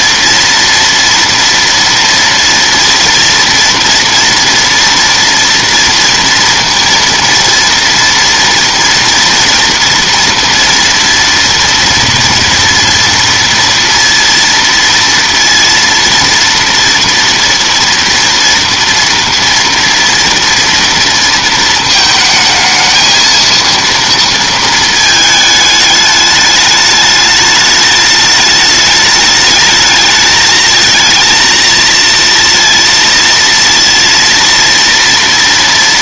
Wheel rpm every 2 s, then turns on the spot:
230, 230, 240, 230, 230, 230, 230, 230, 230, 230, 230, 220, 230, 210, 210, 220, 230, 230.
none